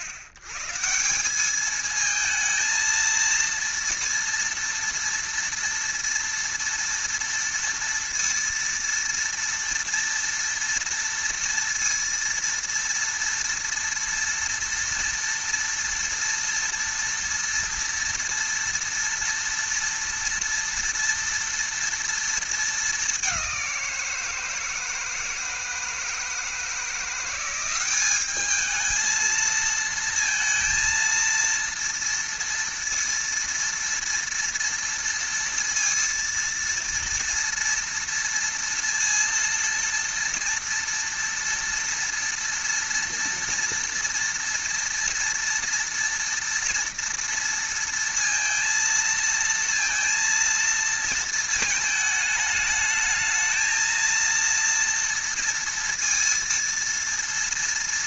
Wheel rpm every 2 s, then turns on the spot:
110, 220, 230, 230, 230, 230, 230, 230, 230, 230, 230, 220, 160, 160, 210, 230, 230, 230, 230, 230, 230, 230, 230, 230, 230, 230, 220, 230, 230.
none